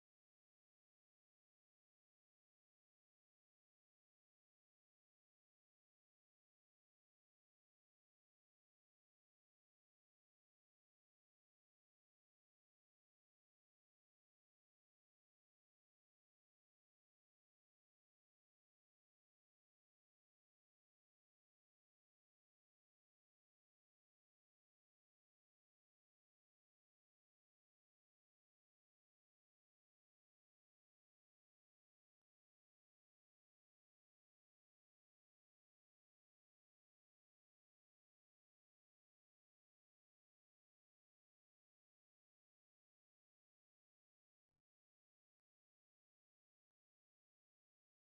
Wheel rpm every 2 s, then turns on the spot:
0, 0, 0, 0, 0, 0, 0, 0, 0, 0, 0, 0, 0, 0, 0, 0, 0, 0, 0, 0, 0, 0, 0, 0.
none